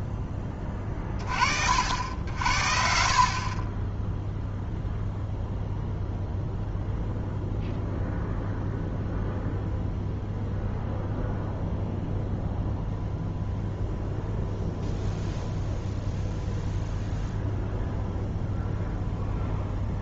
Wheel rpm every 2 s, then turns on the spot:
20, 50, 0, 0, 0, 0, 0, 0, 0, 0.
none